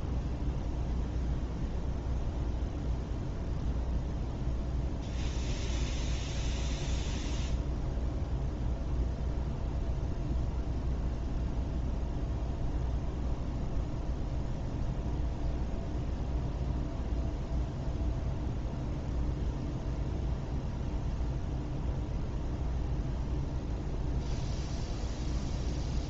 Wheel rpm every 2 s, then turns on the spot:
0, 0, 0, 0, 0, 0, 0, 0, 0, 0, 0, 0, 0.
none